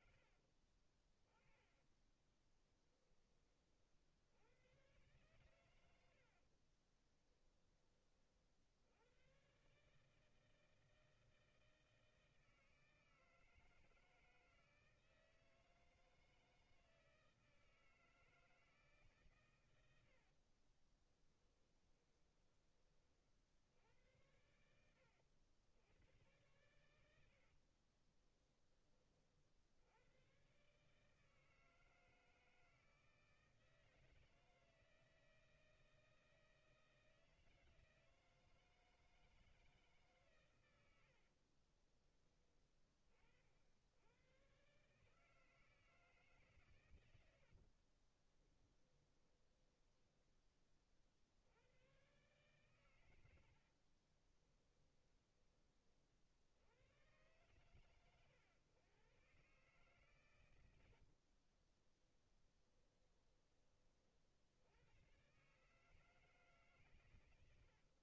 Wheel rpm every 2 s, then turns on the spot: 40, 20, 110, 30, 90, 160, 160, 160, 160, 150, 30, 30, 80, 100, 30, 140, 160, 160, 160, 160, 80, 30, 130, 110, 10, 50, 110, 20, 110, 120, 80, 20, 100, 130.
6-8 20-22 26-28 40-42 48-50 52-56 60-64